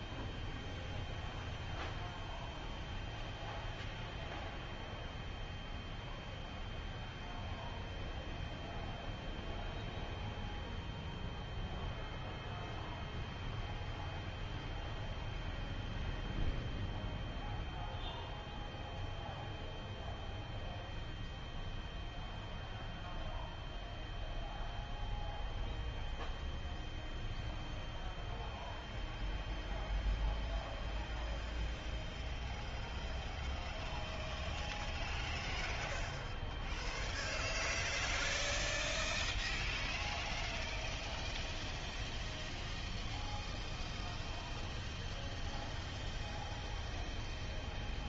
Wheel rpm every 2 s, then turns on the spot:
0, 0, 0, 0, 0, 0, 0, 0, 0, 0, 0, 0, 0, 0, 0, 0, 0, 0, 0, 0, 0, 0, 0, 0.
none